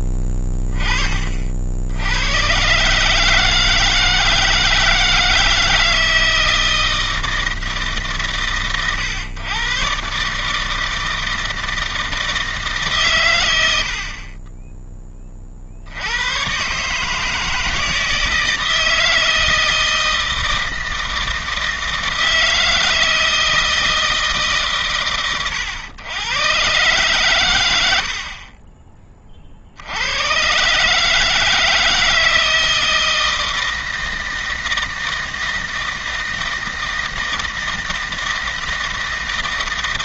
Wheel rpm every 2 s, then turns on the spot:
20, 130, 160, 160, 110, 160, 150, 20, 130, 160, 160, 160, 120, 120, 30, 130, 160, 160, 160, 160.
none